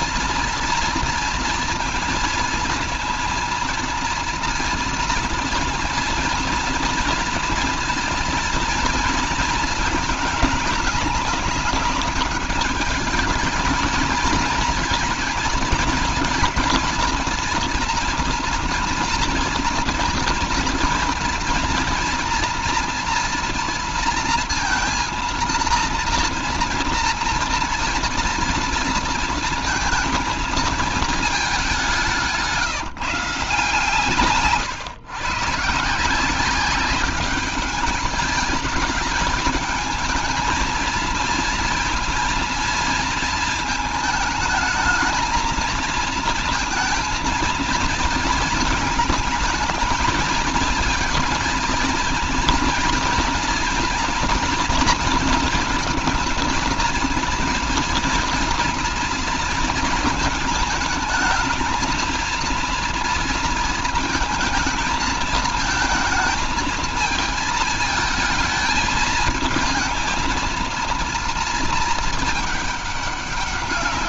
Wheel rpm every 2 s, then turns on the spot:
230, 230, 230, 230, 230, 210, 210, 220, 230, 230, 230, 230, 230, 230, 230, 230, 170, 130, 190, 210, 220, 230, 220, 230, 220, 220, 230, 230, 230, 230, 220, 230, 220, 220, 220, 230, 210.
none